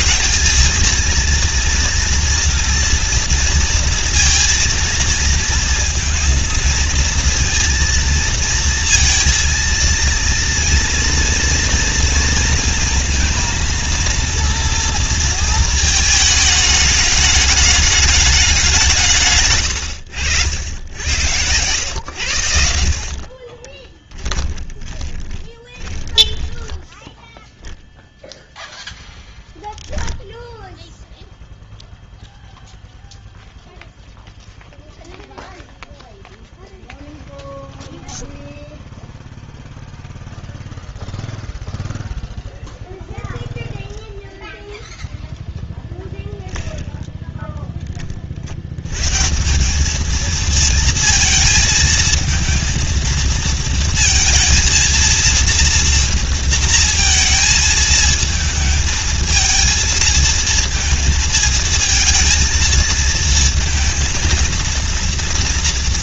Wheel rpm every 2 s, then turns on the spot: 210, 230, 230, 230, 230, 230, 230, 230, 210, 190, 80, 80, 10, 10, 0, 0, 0, 0, 0, 0, 0, 0, 0, 0, 80, 220, 220, 230, 230, 220, 220, 230, 230.
24-28